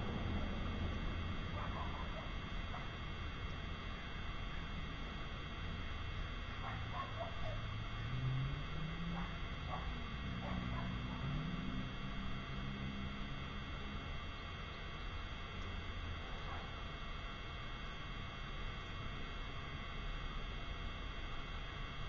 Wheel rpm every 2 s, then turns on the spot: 0, 0, 0, 0, 0, 0, 0, 0, 0, 0, 0.
none